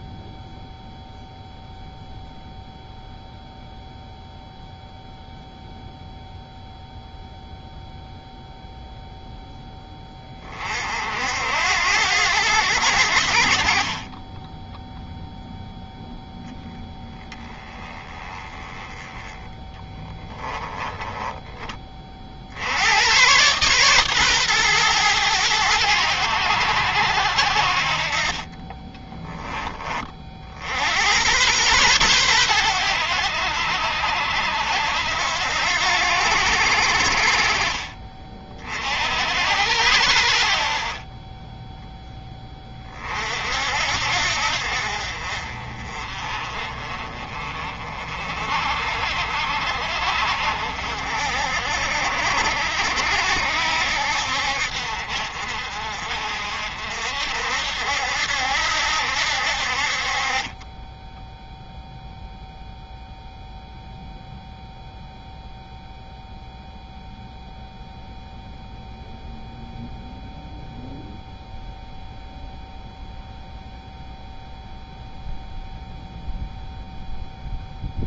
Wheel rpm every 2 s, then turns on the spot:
0, 0, 0, 0, 0, 50, 80, 0, 10, 10, 10, 90, 120, 80, 20, 90, 90, 70, 60, 60, 30, 40, 50, 30, 50, 60, 60, 60, 60, 70, 10, 0, 0, 0, 0, 0, 0, 0, 0.
20-22